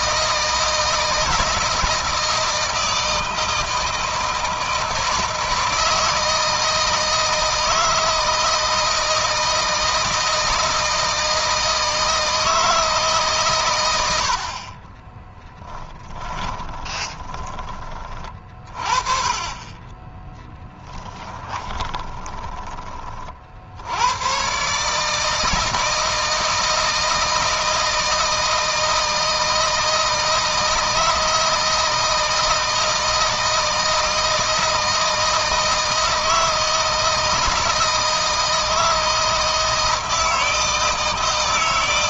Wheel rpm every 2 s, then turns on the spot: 160, 160, 160, 160, 160, 160, 160, 30, 20, 30, 10, 20, 130, 160, 160, 160, 160, 160, 160, 160, 160.
16-18 20-22